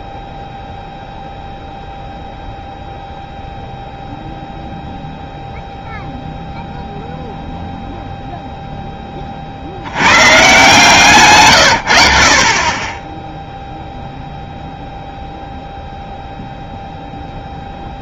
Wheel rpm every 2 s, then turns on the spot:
0, 0, 0, 0, 10, 150, 20, 0, 0.
none